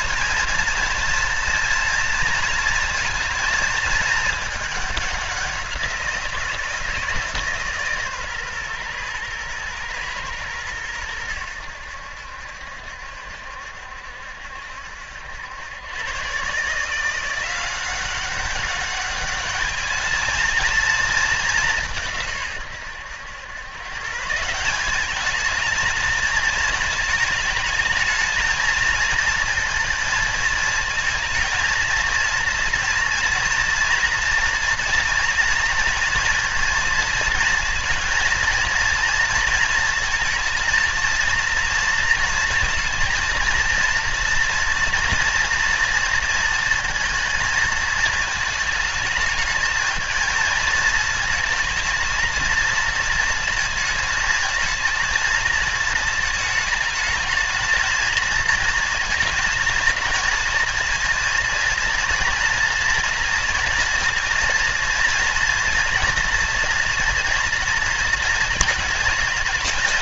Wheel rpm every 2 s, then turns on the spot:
230, 230, 210, 170, 130, 110, 70, 70, 150, 200, 220, 130, 180, 220, 230, 220, 230, 230, 230, 230, 230, 220, 230, 230, 220, 220, 230, 230, 220, 230, 230, 230, 230, 230, 230.
none